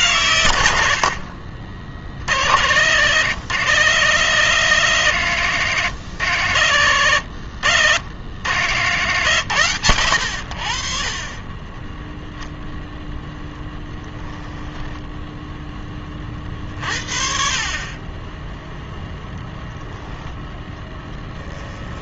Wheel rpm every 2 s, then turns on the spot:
80, 90, 120, 90, 110, 50, 0, 10, 40, 0, 10.
14-16 20-22